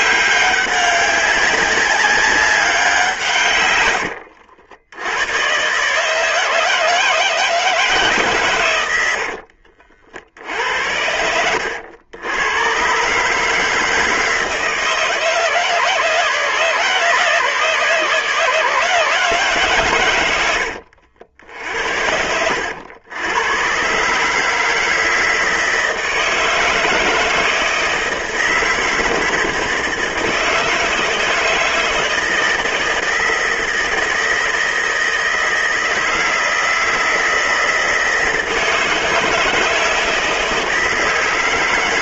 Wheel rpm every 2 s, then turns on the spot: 190, 180, 100, 160, 90, 70, 120, 160, 150, 150, 90, 90, 160, 160, 160, 160, 160, 160, 160, 160, 170.
8-10